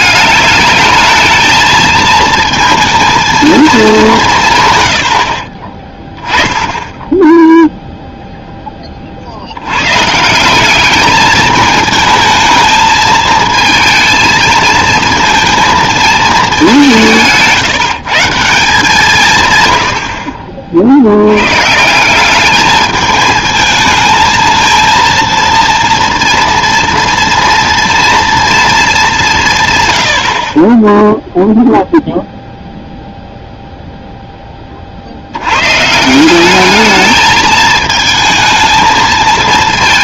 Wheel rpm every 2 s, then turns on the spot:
210, 220, 130, 10, 10, 190, 220, 230, 210, 160, 50, 210, 230, 230, 230, 40, 0, 30, 200, 220.
4-6